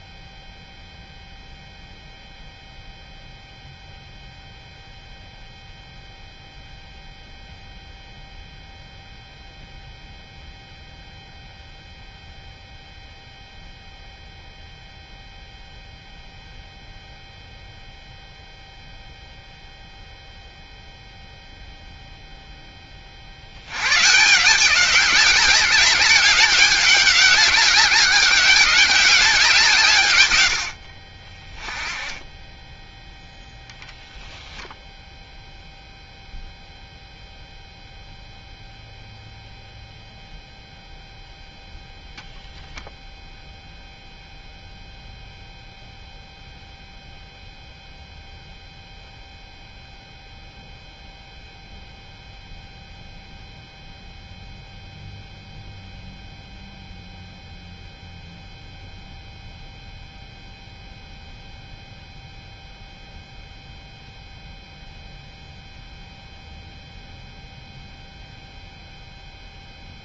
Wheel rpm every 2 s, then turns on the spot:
0, 0, 0, 0, 0, 0, 0, 0, 0, 0, 0, 10, 180, 200, 200, 80, 10, 0, 0, 0, 0, 0, 0, 0, 0, 0, 0, 0, 0, 0, 0, 0, 0, 0, 0.
none